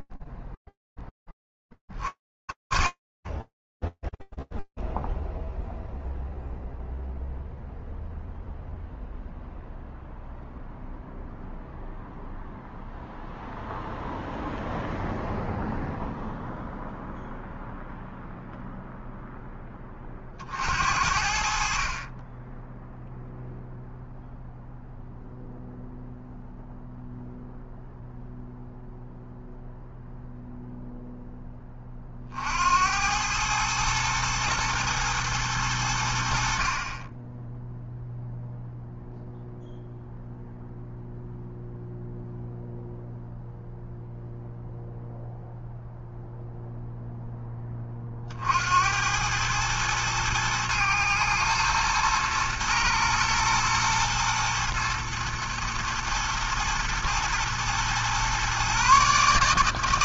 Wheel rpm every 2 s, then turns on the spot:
0, 60, 0, 0, 0, 0, 0, 0, 0, 0, 50, 0, 0, 0, 0, 0, 80, 110, 30, 0, 0, 0, 0, 0, 80, 110, 110, 110, 110, 140.
none